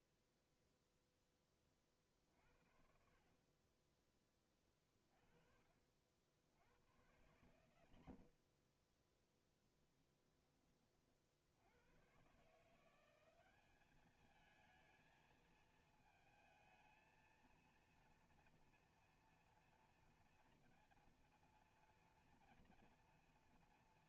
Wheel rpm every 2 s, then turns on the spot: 0, 40, 20, 60, 80, 20, 120, 210, 220, 230, 240, 230.
10-12